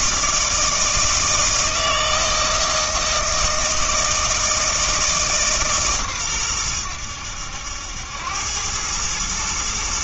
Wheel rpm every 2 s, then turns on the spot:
160, 160, 160, 100, 100.
none